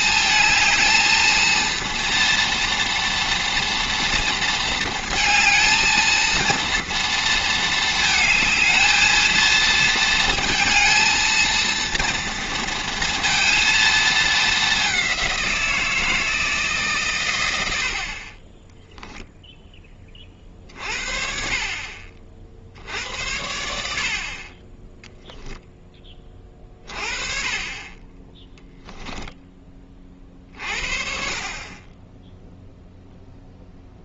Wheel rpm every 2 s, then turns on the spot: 220, 240, 230, 230, 220, 230, 230, 200, 140, 10, 40, 60, 20, 30, 10, 40, 0.
28-30